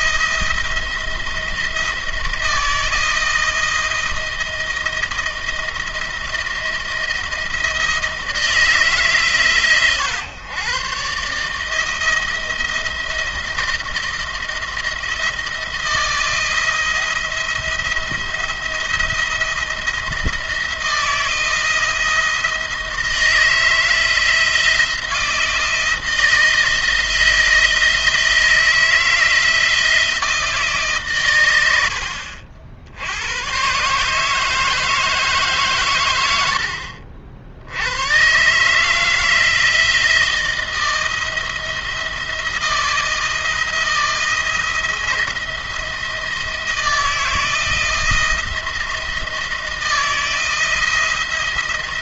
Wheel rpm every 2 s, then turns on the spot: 170, 170, 160, 170, 160, 120, 170, 170, 170, 170, 170, 160, 160, 170, 170, 160, 70, 150, 90, 140, 160, 170, 170, 170, 170, 160.
none